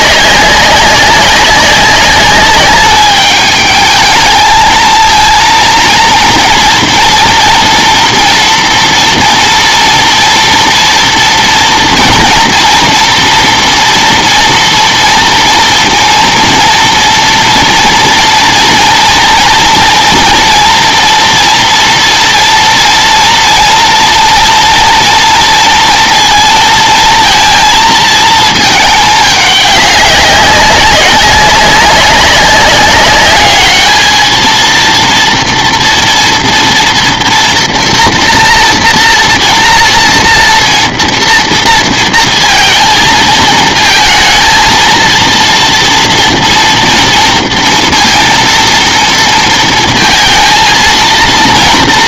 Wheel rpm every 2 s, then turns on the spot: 190, 200, 220, 230, 230, 230, 230, 230, 230, 230, 230, 240, 230, 230, 220, 190, 200, 230, 230, 230, 230, 230, 230, 230, 230, 220.
none